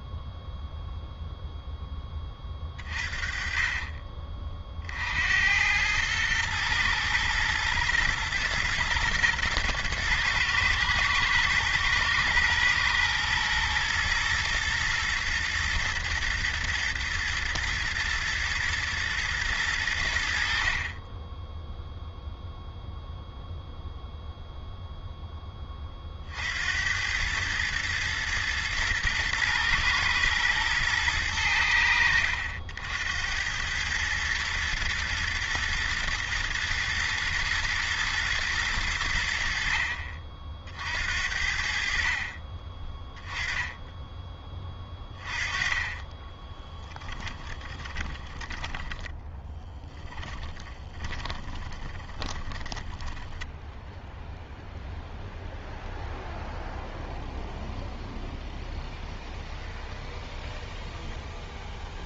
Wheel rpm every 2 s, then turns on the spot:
0, 40, 50, 110, 120, 110, 120, 120, 120, 110, 40, 0, 0, 80, 110, 110, 80, 110, 120, 100, 60, 20, 20, 10, 10, 20, 10, 0, 0, 0, 0.
46-48 50-54